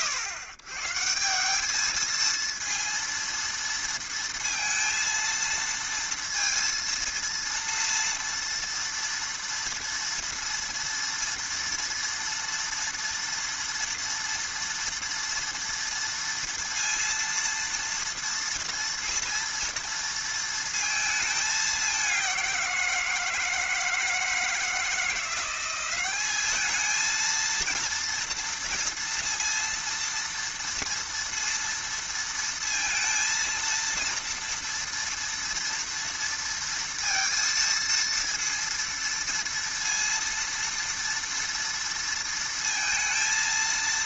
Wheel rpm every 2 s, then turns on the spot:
120, 230, 230, 230, 230, 230, 230, 230, 230, 230, 230, 180, 160, 220, 230, 230, 230, 230, 230, 230, 230, 230.
none